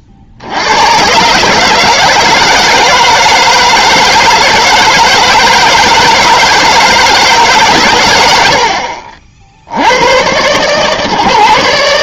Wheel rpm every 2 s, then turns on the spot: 70, 160, 160, 160, 70, 120.
none